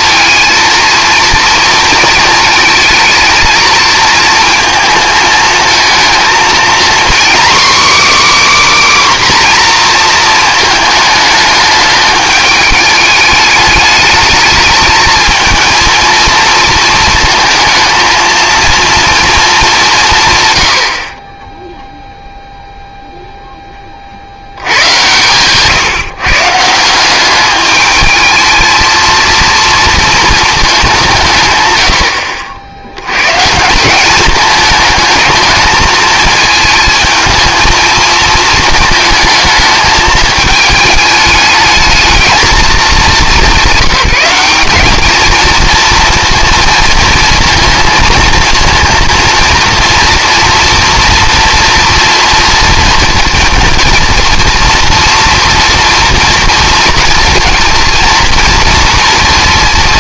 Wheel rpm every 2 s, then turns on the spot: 230, 220, 220, 240, 290, 220, 210, 220, 230, 230, 90, 0, 90, 160, 220, 210, 70, 220, 220, 230, 220, 210, 200, 230, 230, 230, 230, 230, 230, 230.
none